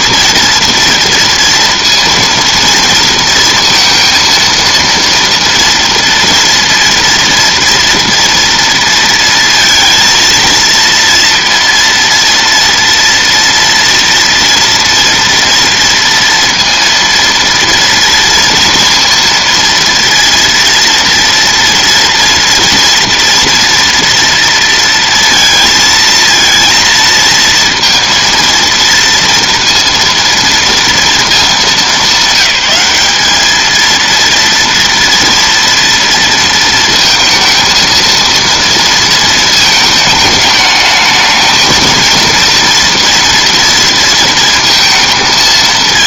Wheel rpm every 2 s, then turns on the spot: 230, 230, 230, 230, 230, 230, 230, 230, 230, 230, 230, 230, 230, 230, 230, 220, 200, 230, 230, 230, 210, 240, 230.
none